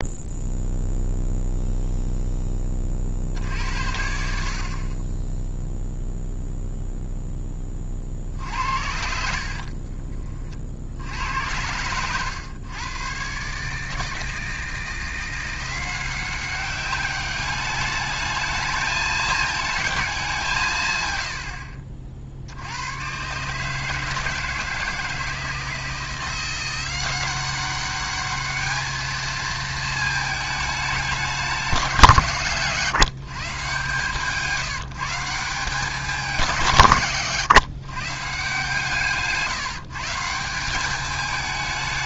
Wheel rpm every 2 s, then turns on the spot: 0, 20, 40, 0, 60, 50, 120, 160, 190, 210, 150, 80, 160, 180, 210, 210, 140, 170, 170, 140, 180.
none